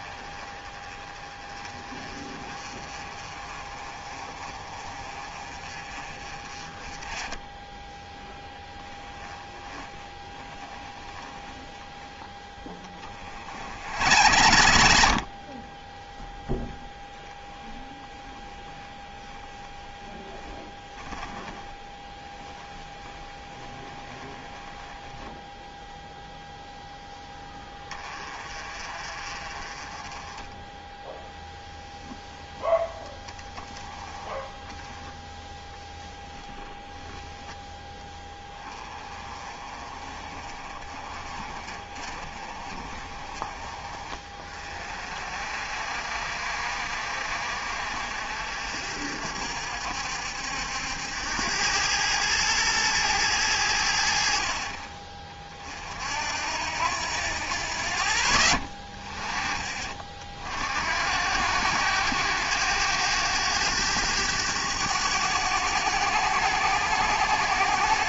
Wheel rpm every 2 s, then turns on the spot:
20, 30, 30, 20, 10, 10, 20, 70, 0, 10, 20, 10, 10, 0, 30, 10, 0, 10, 10, 20, 30, 30, 40, 50, 60, 70, 110, 50, 70, 20, 60, 90, 100, 100.
10-12 18-26 30-32